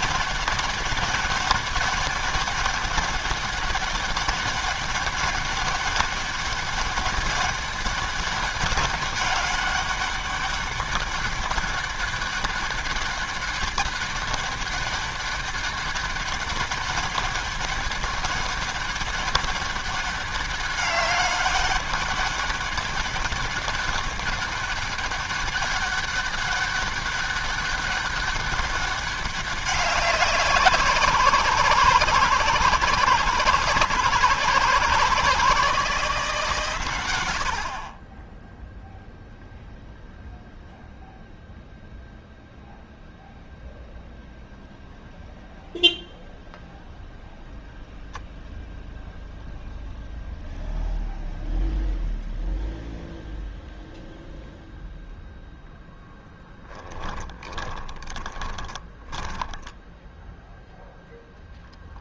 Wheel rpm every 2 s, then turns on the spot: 200, 200, 200, 200, 200, 200, 200, 200, 200, 200, 200, 200, 200, 200, 200, 170, 160, 160, 140, 10, 0, 0, 0, 0, 0, 0, 0, 0, 10, 30, 0.
58-60